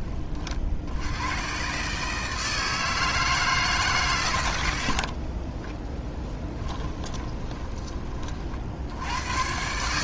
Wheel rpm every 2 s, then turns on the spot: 70, 160, 70, 10, 80.
6-8